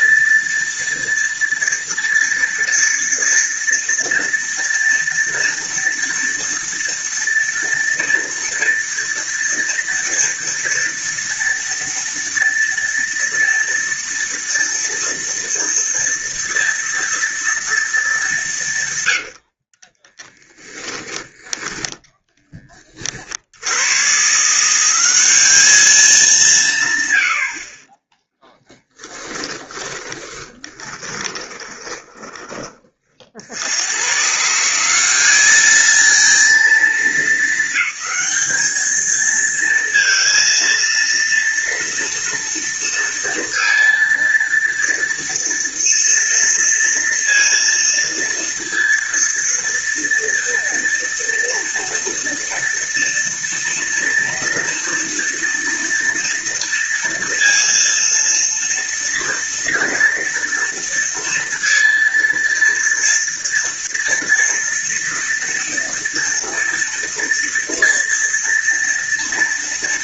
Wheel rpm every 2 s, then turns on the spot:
230, 230, 230, 230, 230, 230, 230, 230, 230, 170, 10, 40, 180, 140, 20, 20, 20, 170, 210, 210, 230, 230, 230, 230, 230, 230, 230, 230, 230, 230, 230, 230, 230, 230, 230.
20-22 28-32